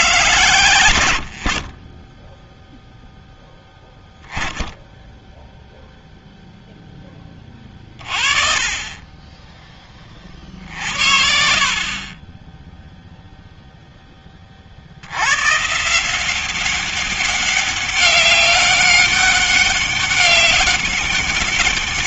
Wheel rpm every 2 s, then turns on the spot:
120, 0, 10, 0, 20, 40, 10, 40, 180, 200, 200.
12-14